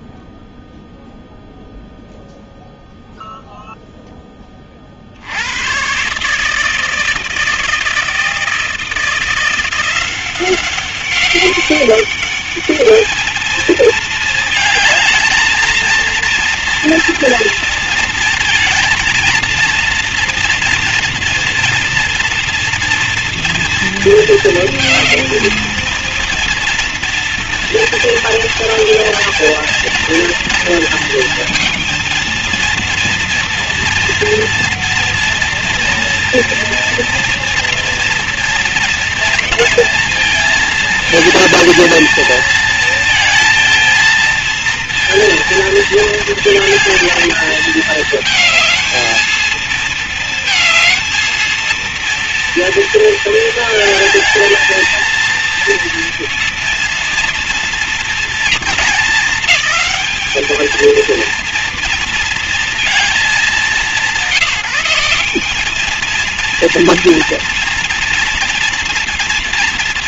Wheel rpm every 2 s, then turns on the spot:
0, 0, 20, 150, 160, 180, 200, 220, 230, 230, 230, 230, 230, 230, 230, 230, 230, 240, 230, 230, 220, 220, 230, 220, 230, 230, 230, 230, 230, 220, 220, 240, 190, 230, 230.
none